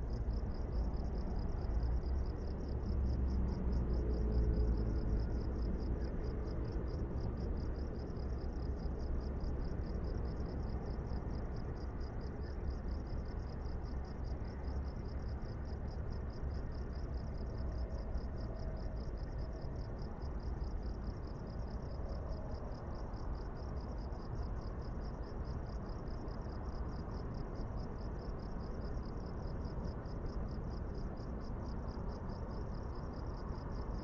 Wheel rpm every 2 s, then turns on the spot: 0, 0, 0, 0, 0, 0, 0, 0, 0, 0, 0, 0, 0, 0, 0, 0, 0.
none